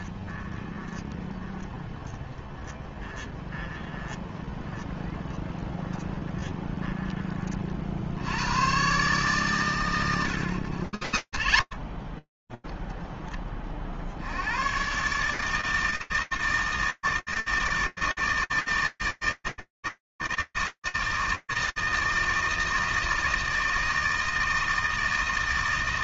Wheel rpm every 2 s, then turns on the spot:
20, 20, 10, 120, 240, 190, 20, 130, 160, 160, 160, 160, 160.
none